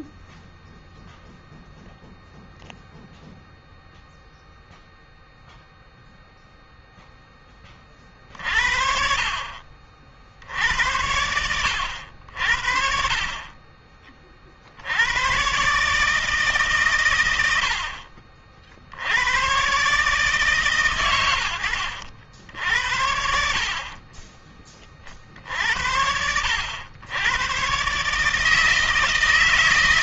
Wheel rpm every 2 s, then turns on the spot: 0, 0, 0, 0, 50, 80, 60, 60, 140, 60, 140, 70, 30, 80, 160.
none